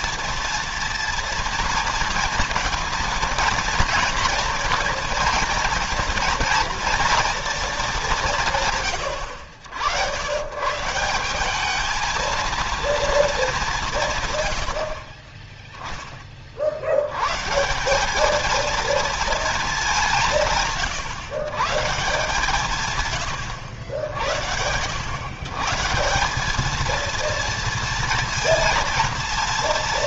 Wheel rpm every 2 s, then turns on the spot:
230, 230, 230, 230, 140, 140, 230, 80, 60, 220, 150, 140, 90, 210, 230.
none